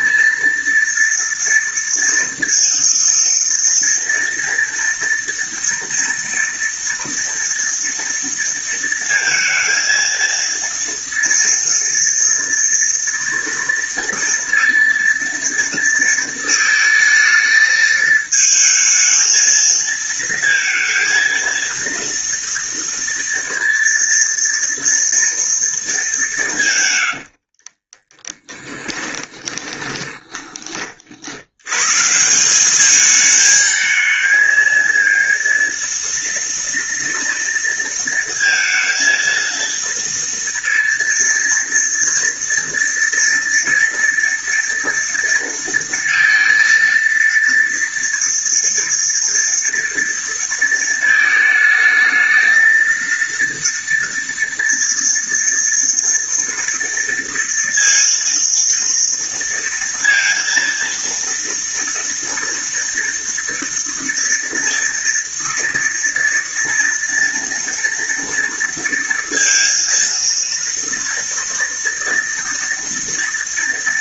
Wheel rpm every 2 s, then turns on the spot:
230, 230, 230, 230, 230, 230, 230, 230, 230, 220, 230, 230, 230, 160, 10, 20, 170, 220, 230, 230, 230, 230, 230, 230, 230, 230, 220, 230, 230, 230, 230, 230, 230, 230, 230, 230, 230.
28-32